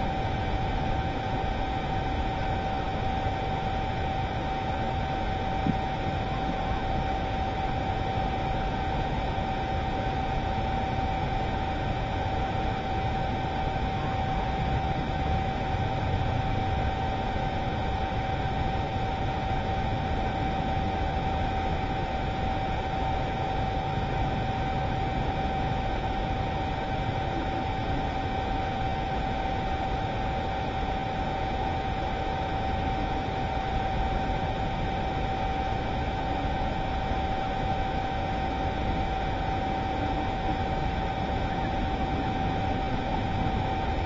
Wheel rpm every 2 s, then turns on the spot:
0, 0, 0, 0, 0, 0, 0, 0, 0, 0, 0, 0, 0, 0, 0, 0, 0, 0, 0, 0, 0, 0.
none